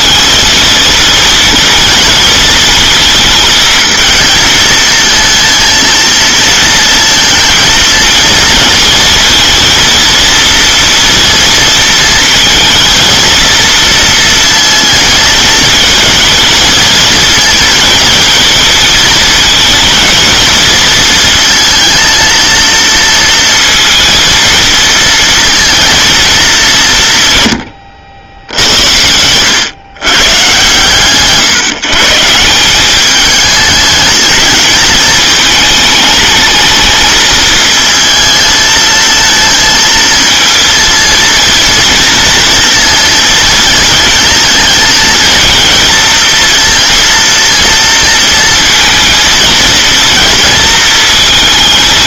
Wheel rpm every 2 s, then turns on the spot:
220, 220, 220, 230, 230, 230, 220, 230, 230, 220, 220, 230, 230, 200, 90, 130, 170, 210, 220, 220, 230, 230, 220, 230, 230, 230.
none